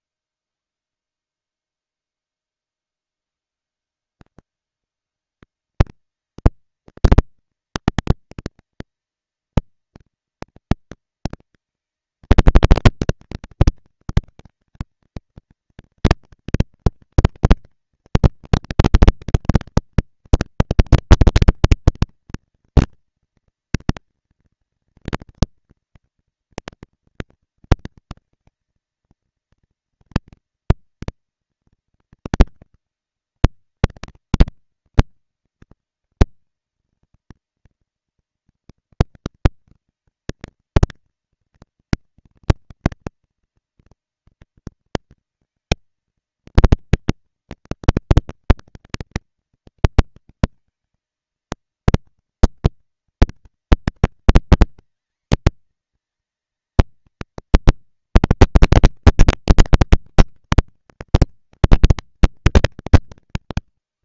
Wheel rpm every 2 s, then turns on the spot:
30, 100, 190, 230, 230, 230, 230, 220, 230, 230, 230, 230, 230, 230, 230, 230, 210, 200, 220, 230, 230, 230, 230, 230, 230, 230, 230, 230, 220, 230, 220, 200.
none